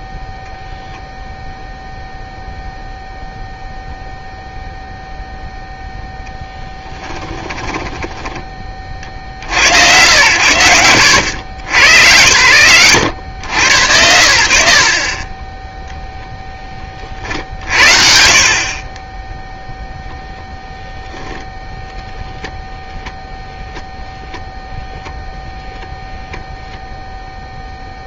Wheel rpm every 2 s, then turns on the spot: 0, 0, 0, 10, 20, 90, 110, 70, 30, 50, 0, 0, 0, 0.
6-8